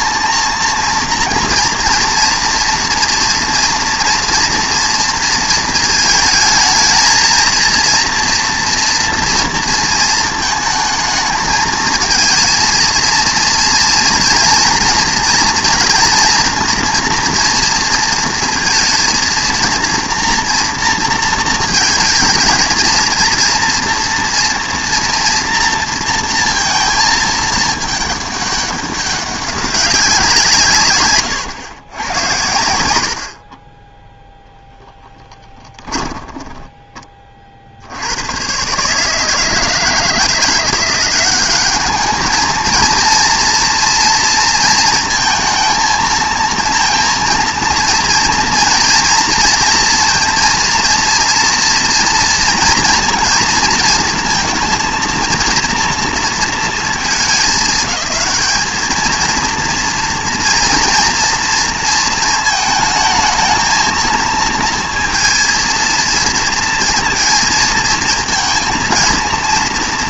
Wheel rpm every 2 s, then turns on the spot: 230, 230, 230, 220, 240, 220, 230, 230, 230, 230, 230, 230, 230, 220, 200, 150, 100, 10, 20, 140, 170, 220, 230, 230, 230, 230, 230, 230, 220, 210, 230, 220, 230, 230, 230.
34-38